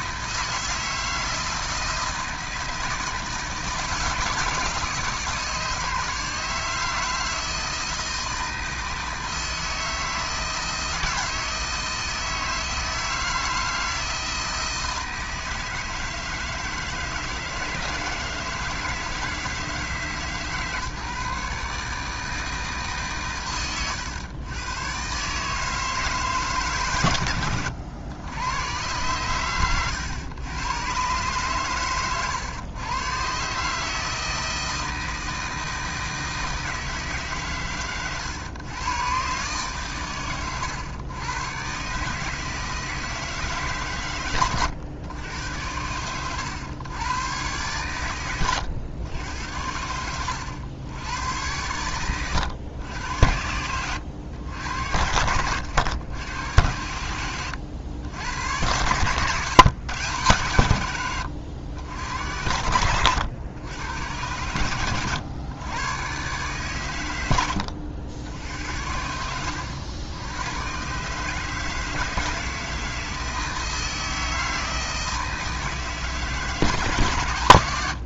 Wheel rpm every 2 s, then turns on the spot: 160, 160, 150, 160, 160, 160, 160, 160, 160, 160, 150, 140, 130, 130, 110, 120, 120, 160, 150, 130, 110, 160, 110, 110, 100, 90, 90, 80, 90, 100, 110, 90, 100, 120, 70, 130, 160, 160, 150.
none